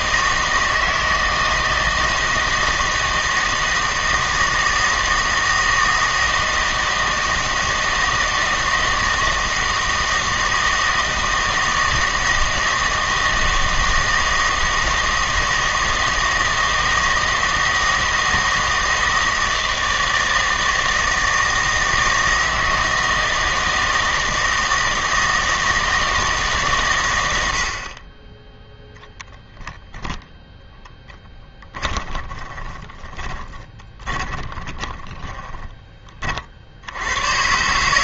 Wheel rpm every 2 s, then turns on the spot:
160, 160, 160, 160, 160, 160, 160, 160, 160, 160, 160, 160, 160, 140, 0, 10, 20, 20, 50.
32-36